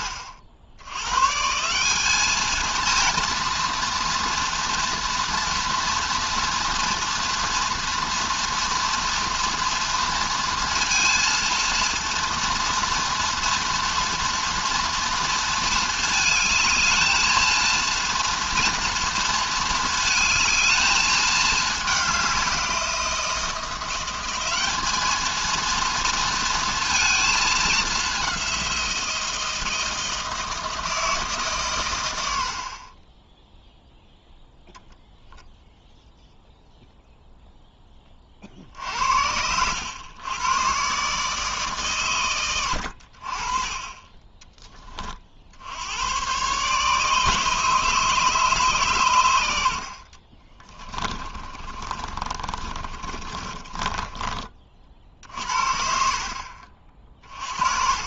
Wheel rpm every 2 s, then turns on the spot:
90, 230, 230, 230, 230, 230, 230, 230, 220, 230, 220, 170, 210, 230, 180, 160, 30, 0, 0, 80, 140, 60, 30, 150, 130, 20, 30, 50, 40.
50-54 56-58